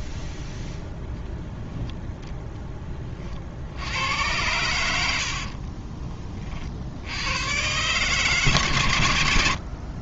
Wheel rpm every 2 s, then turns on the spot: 0, 10, 100, 40, 130.
none